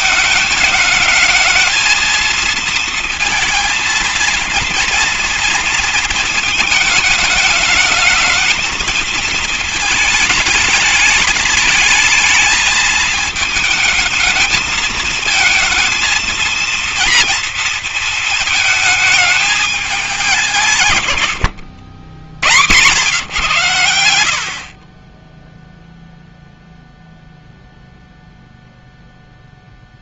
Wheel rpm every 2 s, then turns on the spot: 220, 230, 230, 220, 220, 220, 220, 220, 230, 220, 180, 100, 70, 0, 0.
none